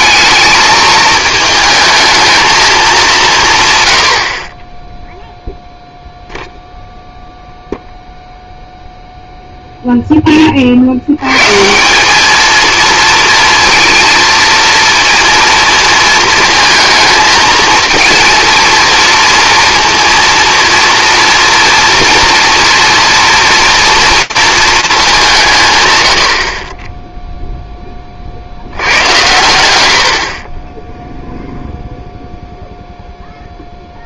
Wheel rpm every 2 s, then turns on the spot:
220, 210, 20, 0, 0, 50, 230, 230, 230, 230, 230, 240, 220, 30, 90, 20, 0.
none